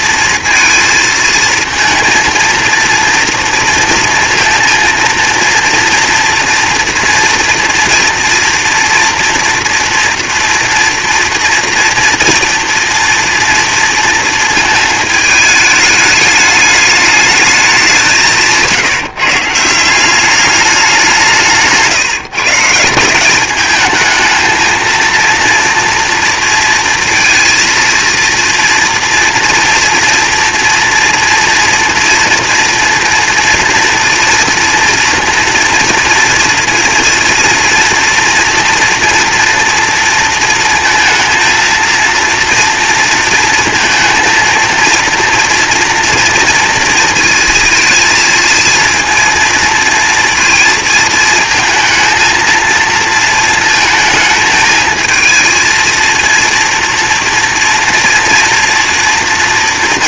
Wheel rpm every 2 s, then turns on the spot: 230, 230, 230, 230, 240, 240, 230, 220, 210, 160, 180, 180, 230, 230, 230, 230, 230, 230, 230, 230, 230, 230, 230, 230, 230, 220, 220, 220, 230, 230.
none